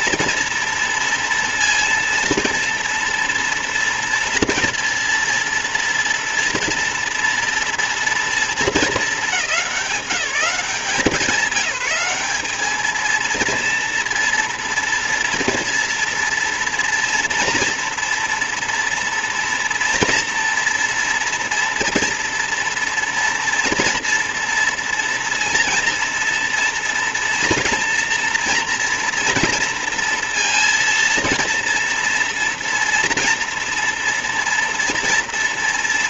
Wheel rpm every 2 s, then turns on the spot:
230, 230, 230, 230, 220, 190, 210, 230, 230, 230, 230, 230, 230, 230, 230, 230, 230, 230.
none